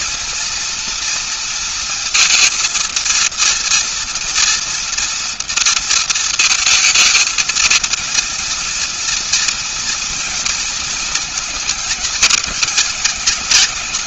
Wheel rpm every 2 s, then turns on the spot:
230, 230, 240, 230, 230, 230, 210.
none